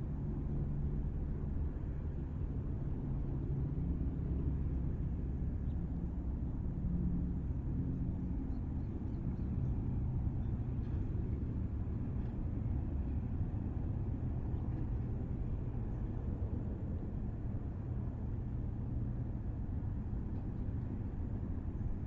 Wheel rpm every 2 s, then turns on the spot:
0, 0, 0, 0, 0, 0, 0, 0, 0, 0, 0.
none